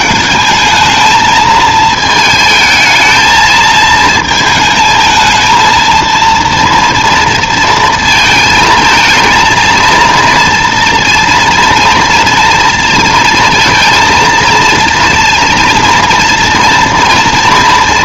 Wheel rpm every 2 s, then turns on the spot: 220, 220, 220, 230, 220, 230, 230, 230, 240.
none